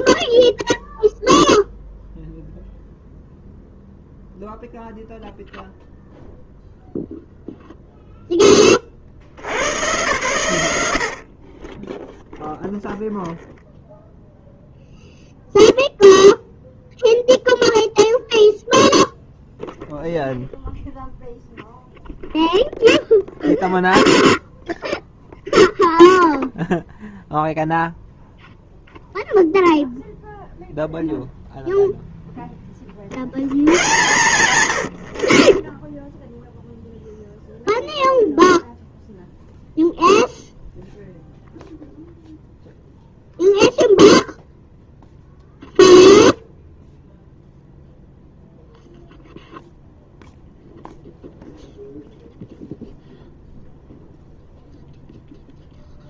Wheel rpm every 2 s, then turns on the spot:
0, 0, 0, 0, 20, 110, 0, 0, 0, 0, 0, 0, 0, 0, 0, 0, 10, 100, 0, 0, 0, 0, 0, 0, 0, 0, 0, 0.
none